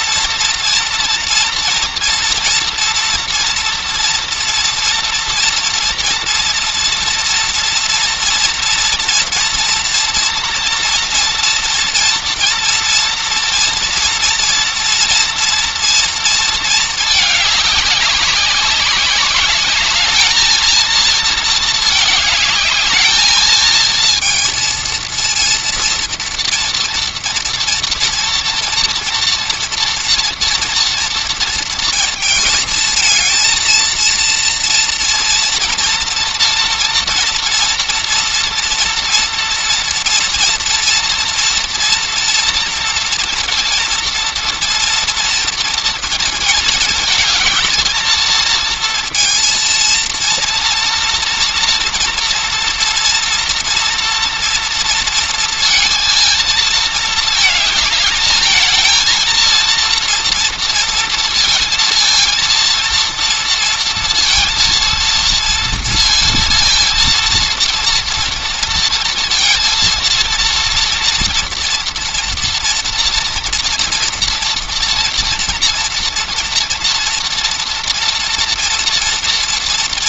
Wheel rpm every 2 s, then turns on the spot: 230, 230, 230, 230, 230, 230, 240, 230, 220, 190, 230, 210, 230, 230, 240, 230, 220, 230, 230, 240, 240, 230, 230, 220, 230, 230, 230, 230, 220, 220, 230, 230, 230, 230, 230, 230, 230, 230, 230, 230.
none